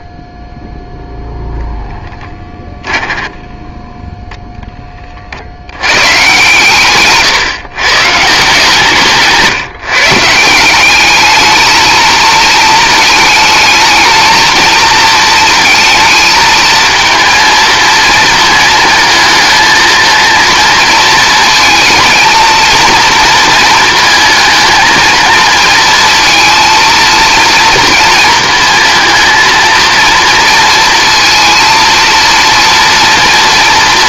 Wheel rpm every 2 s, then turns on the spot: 10, 10, 10, 130, 160, 190, 220, 230, 220, 230, 230, 230, 220, 230, 230, 220, 230.
2-4